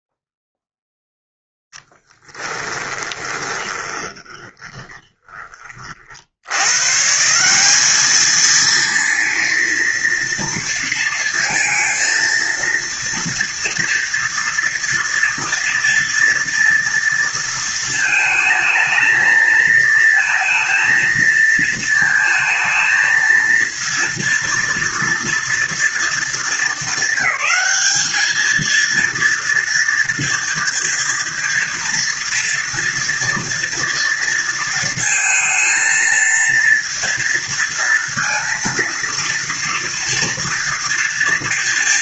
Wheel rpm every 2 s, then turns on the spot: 0, 20, 20, 130, 230, 230, 230, 230, 230, 220, 230, 230, 240, 200, 230, 230, 230, 220, 230, 230, 230.
2-6